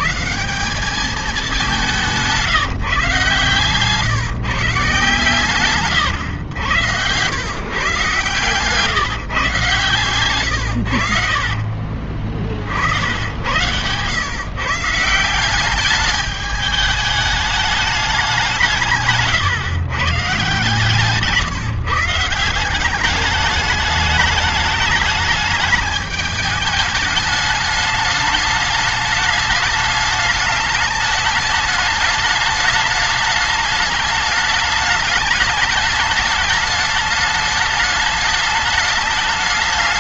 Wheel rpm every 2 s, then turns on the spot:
170, 150, 100, 140, 110, 60, 130, 210, 190, 140, 170, 210, 210, 210, 210, 210, 210, 210, 210, 210.
8-10